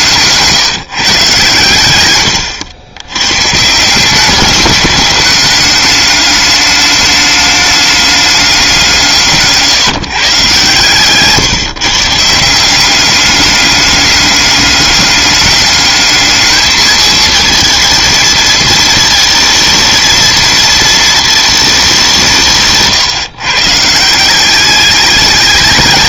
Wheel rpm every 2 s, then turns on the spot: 170, 100, 200, 210, 190, 140, 170, 200, 210, 220, 230, 150, 190.
none